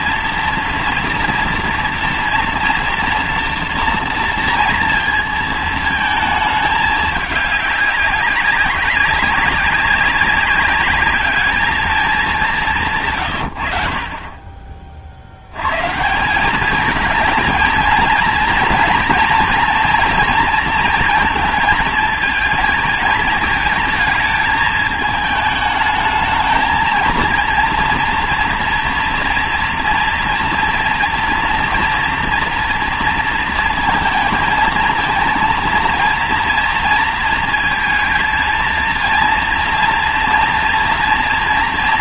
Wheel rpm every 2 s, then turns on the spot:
230, 230, 230, 210, 200, 200, 180, 30, 200, 230, 230, 220, 210, 220, 230, 230, 230, 230, 230, 230, 230.
none